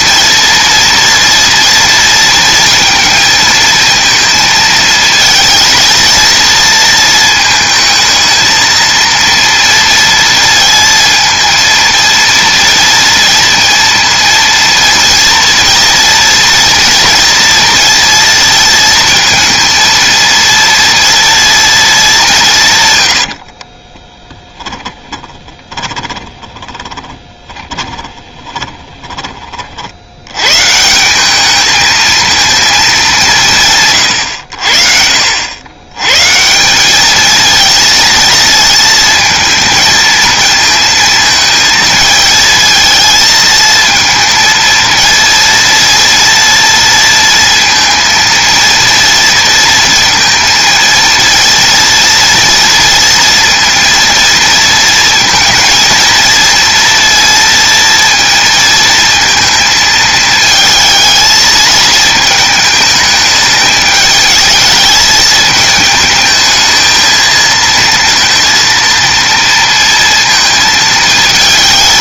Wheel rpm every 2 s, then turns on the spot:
230, 230, 220, 230, 220, 230, 230, 230, 230, 230, 230, 170, 10, 20, 20, 140, 220, 80, 160, 220, 220, 220, 230, 230, 230, 230, 230, 230, 230, 230, 220, 220, 210, 220, 230, 220.
24-30